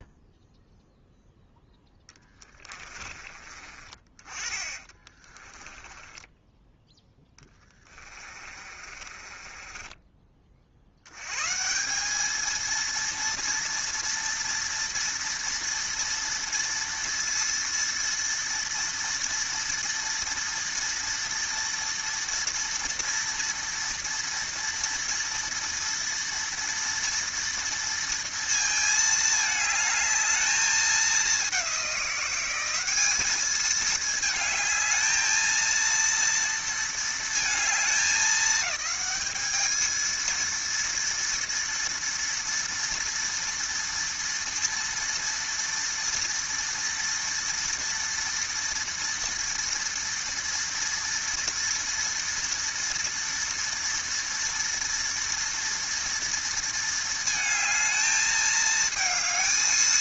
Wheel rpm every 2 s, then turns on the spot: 0, 10, 30, 10, 30, 30, 200, 230, 230, 230, 230, 230, 230, 230, 230, 220, 190, 220, 230, 210, 220, 230, 230, 230, 230, 230, 230, 230, 230, 220.
2-4 6-12